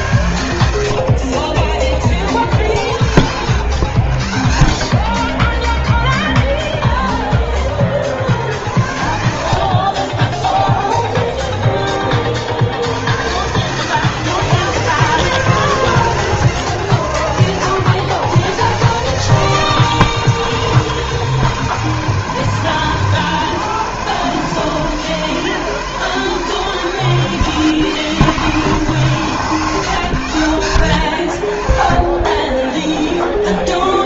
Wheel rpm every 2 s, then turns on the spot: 80, 70, 60, 10, 60, 20, 80, 160, 130, 120, 150, 120, 130, 130, 160, 100, 30.
6-8 10-12 32-34